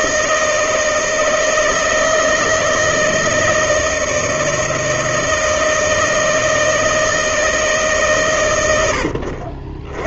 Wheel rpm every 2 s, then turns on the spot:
160, 160, 160, 160, 80.
none